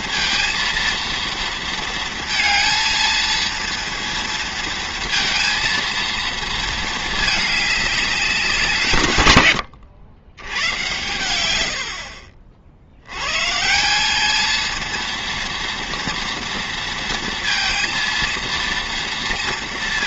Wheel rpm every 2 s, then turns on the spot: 230, 230, 230, 230, 160, 100, 60, 220, 230, 230.
none